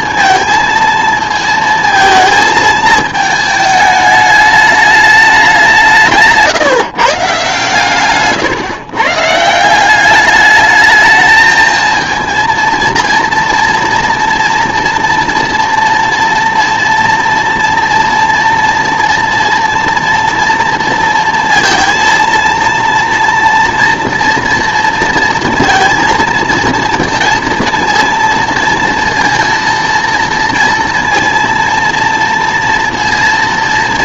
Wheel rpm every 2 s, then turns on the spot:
230, 220, 210, 160, 130, 210, 230, 230, 230, 230, 230, 230, 230, 230, 230, 230, 230.
none